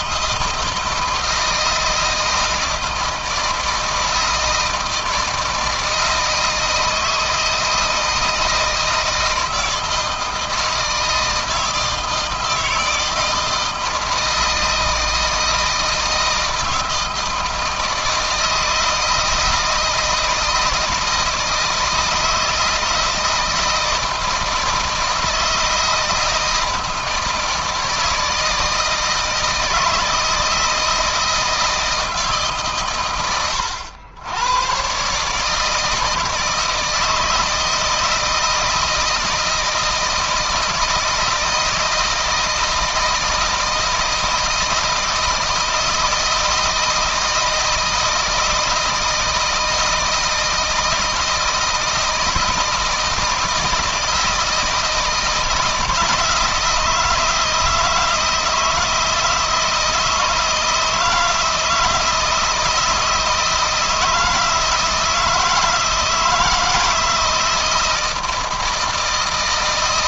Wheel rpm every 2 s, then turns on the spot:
160, 160, 160, 160, 160, 160, 160, 160, 160, 160, 160, 160, 160, 160, 160, 160, 130, 130, 160, 160, 160, 160, 160, 160, 160, 160, 160, 160, 160, 160, 160, 160, 160, 160, 160.
none